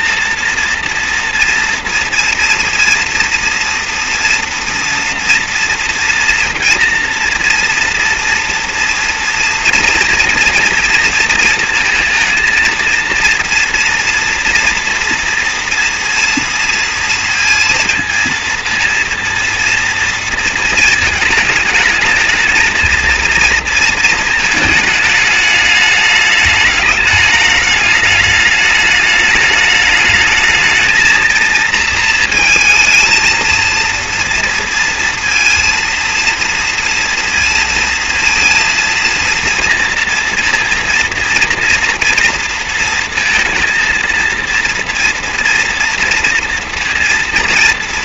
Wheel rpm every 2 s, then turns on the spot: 230, 230, 230, 240, 230, 230, 230, 230, 230, 230, 220, 230, 210, 210, 210, 220, 230, 230, 230, 230, 230, 230, 240, 230.
none